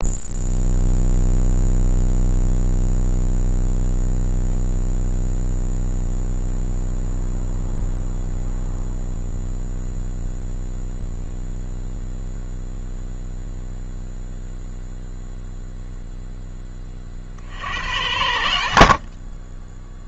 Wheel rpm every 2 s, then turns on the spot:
0, 0, 0, 0, 0, 0, 0, 0, 20, 60.
none